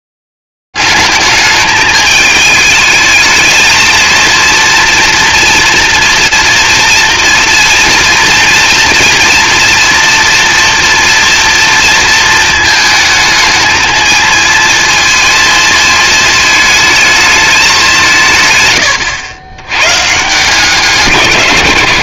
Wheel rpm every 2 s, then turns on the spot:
40, 210, 220, 230, 240, 240, 230, 220, 230, 200, 120.
none